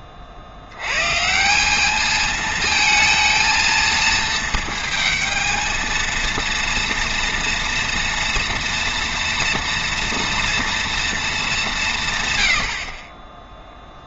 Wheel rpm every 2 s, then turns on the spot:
70, 220, 220, 230, 230, 240, 90.
none